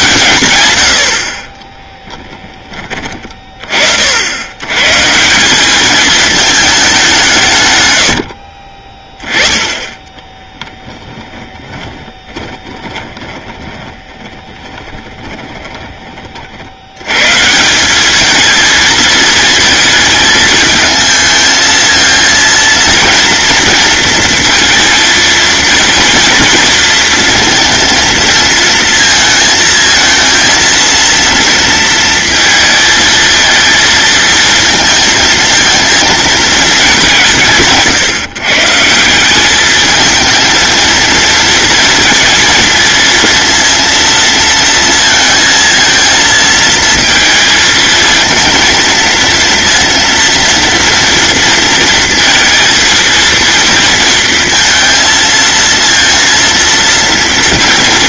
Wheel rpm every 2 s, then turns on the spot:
80, 30, 140, 200, 30, 10, 20, 20, 100, 220, 220, 230, 230, 230, 220, 230, 230, 220, 200, 170, 230, 230, 230, 220, 230, 230, 230, 230, 230.
10-16